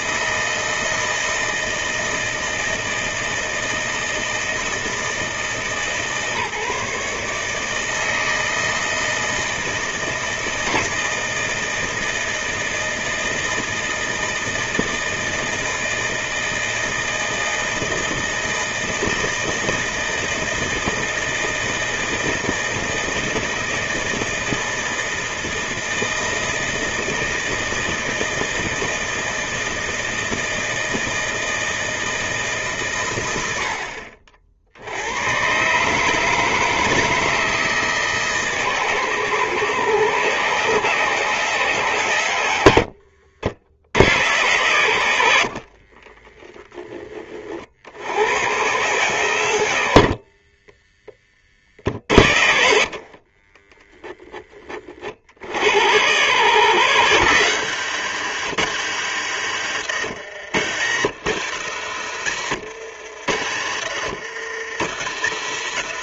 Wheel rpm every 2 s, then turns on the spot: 160, 160, 160, 150, 160, 160, 160, 160, 160, 160, 160, 160, 160, 160, 160, 160, 120, 80, 160, 140, 150, 70, 100, 20, 120, 20, 70, 40, 100, 100, 80, 70, 80.
52-54